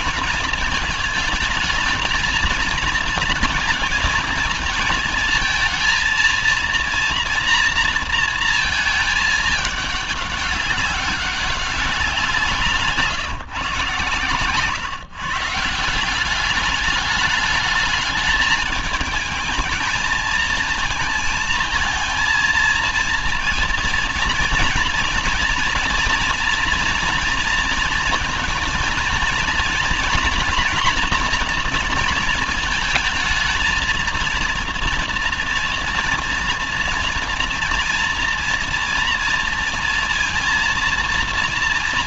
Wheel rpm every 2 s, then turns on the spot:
220, 230, 220, 230, 210, 200, 150, 140, 210, 220, 230, 230, 230, 230, 230, 230, 220, 230, 230, 230, 230.
none